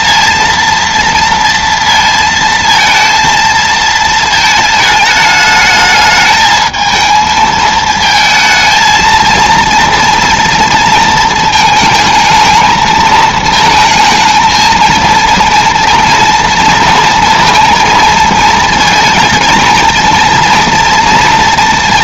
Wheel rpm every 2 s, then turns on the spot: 230, 230, 220, 220, 220, 230, 220, 220, 230, 230, 230.
none